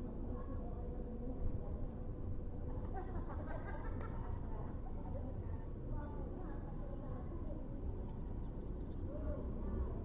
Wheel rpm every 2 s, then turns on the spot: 0, 0, 0, 0, 0.
none